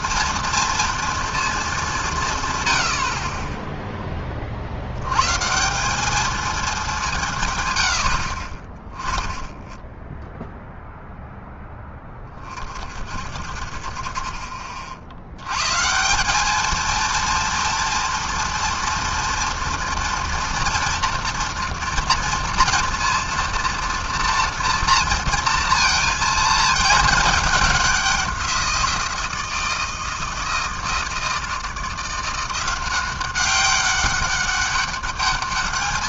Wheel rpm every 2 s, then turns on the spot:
230, 110, 50, 220, 50, 0, 30, 50, 210, 240, 240, 230, 230, 220, 180, 160, 170, 200.
none